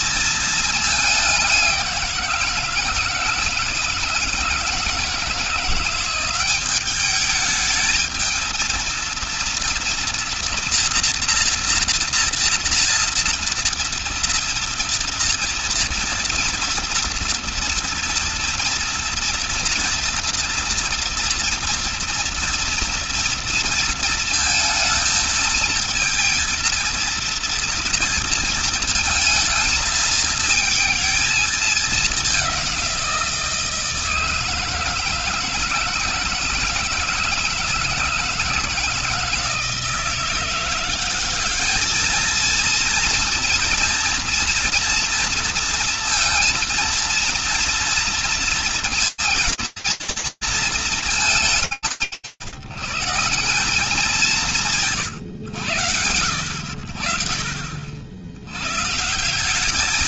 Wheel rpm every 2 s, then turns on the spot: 210, 170, 160, 200, 230, 230, 230, 230, 230, 240, 230, 230, 220, 230, 220, 220, 180, 160, 160, 160, 190, 230, 230, 230, 230, 210, 140, 150, 60, 160.
none